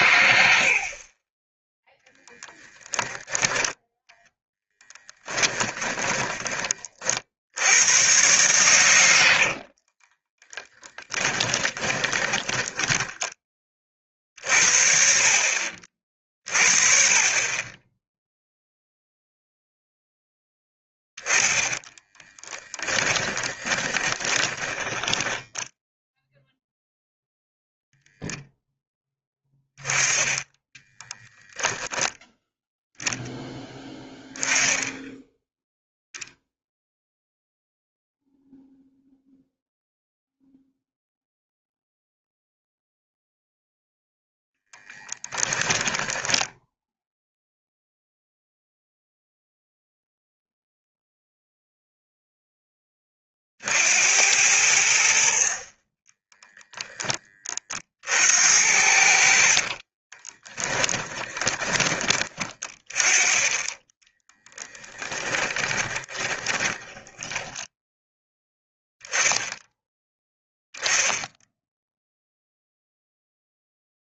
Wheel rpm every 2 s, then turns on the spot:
50, 10, 10, 40, 100, 10, 20, 50, 40, 0, 0, 30, 20, 0, 10, 20, 0, 10, 0, 0, 0, 0, 10, 10, 0, 0, 20, 70, 10, 70, 20, 20, 10, 20, 0, 10, 0.
4-6 10-14 22-26 30-32 44-48 60-62 64-68